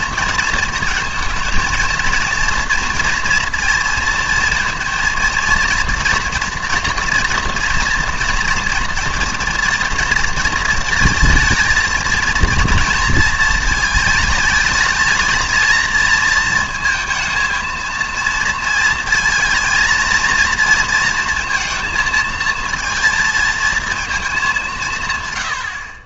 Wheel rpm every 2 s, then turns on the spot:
230, 230, 230, 240, 230, 220, 230, 220, 230, 230, 230, 230, 170.
none